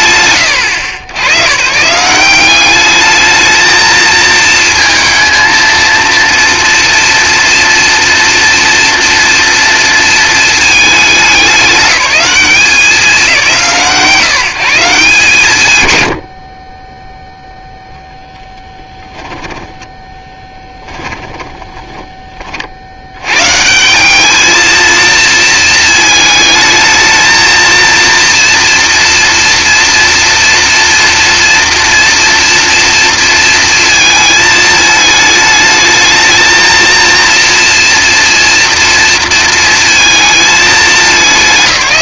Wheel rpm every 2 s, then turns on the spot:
110, 220, 230, 230, 230, 210, 180, 160, 0, 10, 20, 150, 220, 230, 230, 230, 230, 220, 230, 230, 150.
18-22